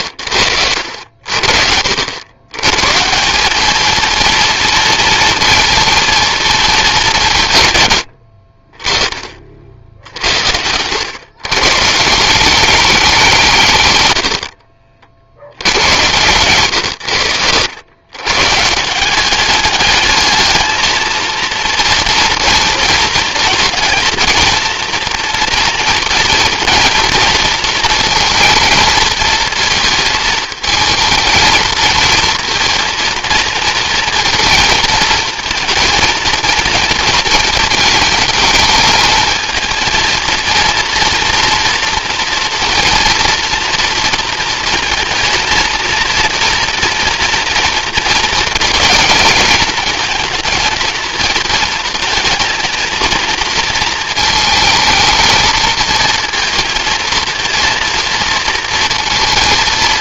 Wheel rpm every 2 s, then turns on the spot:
80, 120, 230, 220, 30, 90, 190, 60, 120, 150, 220, 230, 230, 240, 220, 220, 230, 230, 230, 220, 230, 230, 230, 240, 230, 230, 230, 220, 230, 230.
14-18